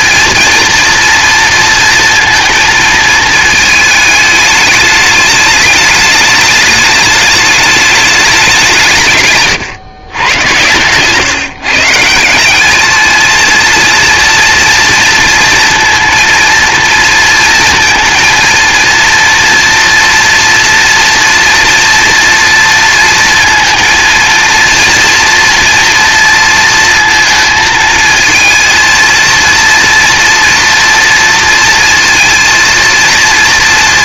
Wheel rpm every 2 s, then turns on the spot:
230, 220, 210, 210, 130, 130, 220, 230, 230, 230, 240, 230, 230, 230, 230, 230, 230.
none